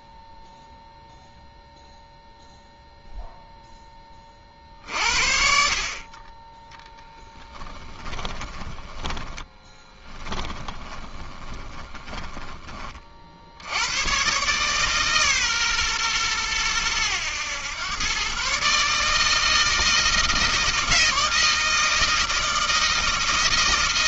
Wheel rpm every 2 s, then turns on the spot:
0, 0, 40, 20, 20, 10, 20, 130, 110, 130, 160, 160.
6-12